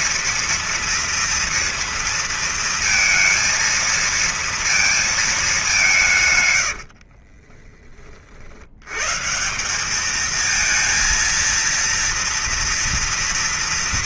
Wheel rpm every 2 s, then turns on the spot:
230, 230, 230, 60, 120, 230, 230.
6-8